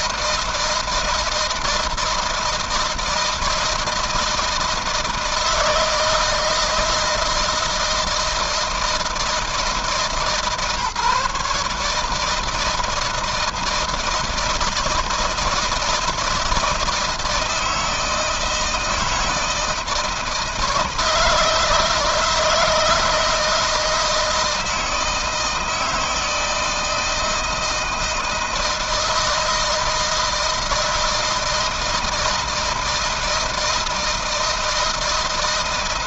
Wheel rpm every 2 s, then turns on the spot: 160, 160, 160, 160, 160, 150, 160, 160, 160, 160, 160, 160, 160, 160, 160, 160, 160, 160.
none